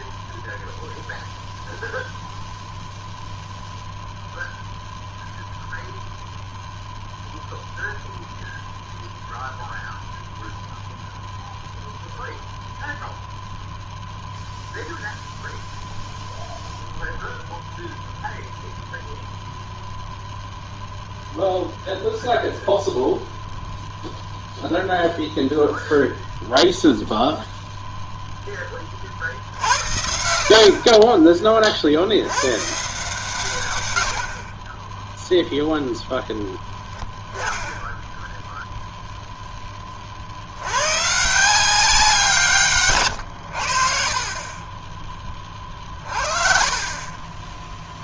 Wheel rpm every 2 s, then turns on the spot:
0, 0, 0, 0, 0, 0, 0, 0, 0, 0, 0, 0, 0, 0, 20, 50, 120, 40, 0, 0, 70, 160, 30, 40.
none